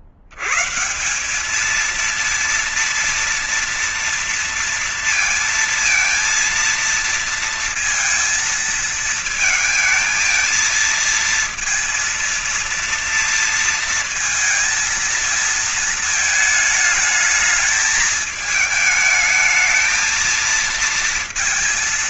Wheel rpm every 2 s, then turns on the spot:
60, 230, 230, 230, 230, 220, 230, 230, 220, 220, 220.
none